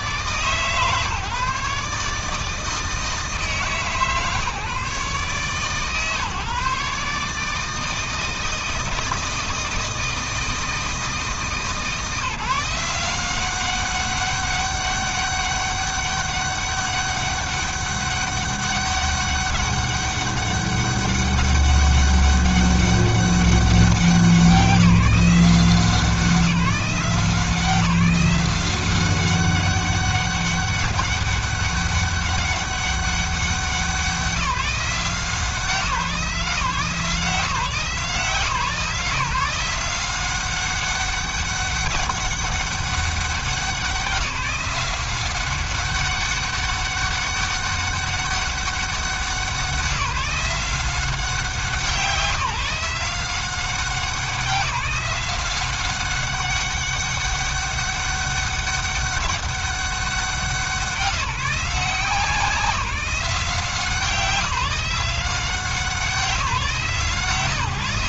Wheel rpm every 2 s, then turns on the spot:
150, 160, 150, 140, 160, 160, 170, 200, 200, 200, 200, 200, 170, 170, 190, 200, 200, 180, 160, 150, 190, 200, 180, 200, 190, 180, 160, 180, 200, 200, 190, 180, 170, 160.
none